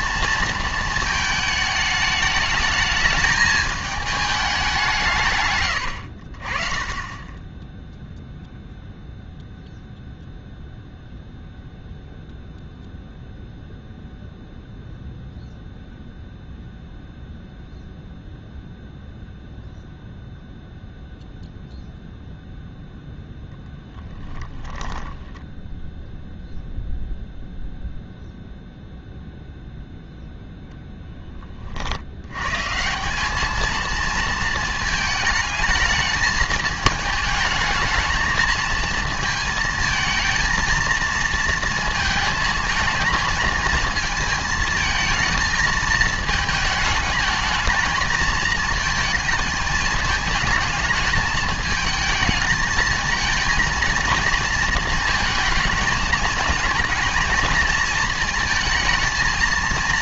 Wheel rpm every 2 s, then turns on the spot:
220, 210, 180, 40, 0, 0, 0, 0, 0, 0, 0, 0, 0, 0, 0, 0, 150, 220, 220, 220, 220, 230, 220, 220, 220, 220, 220, 220, 220, 230.
none